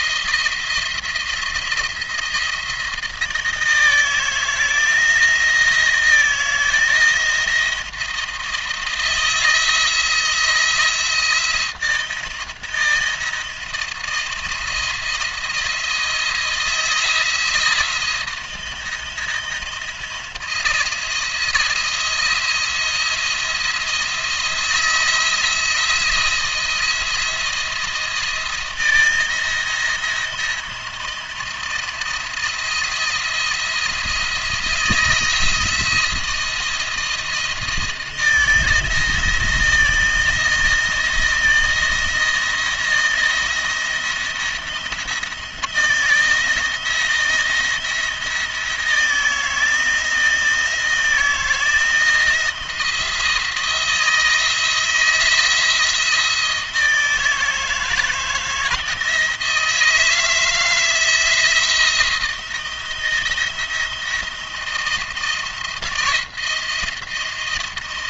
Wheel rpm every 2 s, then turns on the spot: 170, 170, 170, 170, 170, 170, 170, 170, 170, 170, 170, 170, 170, 170, 160, 170, 170, 170, 170, 170, 160, 170, 170, 170, 160, 160, 160, 170, 160, 160, 160, 170, 170, 170.
none